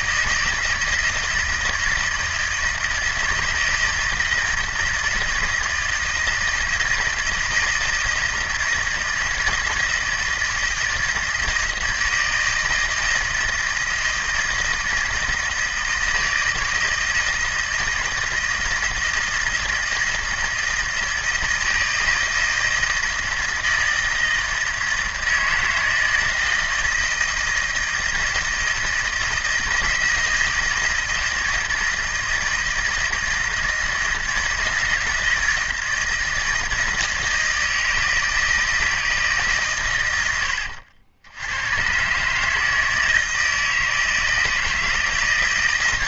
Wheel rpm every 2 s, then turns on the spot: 160, 160, 160, 170, 160, 160, 160, 160, 160, 160, 160, 160, 160, 160, 160, 160, 160, 160, 160, 160, 80, 150, 160.
none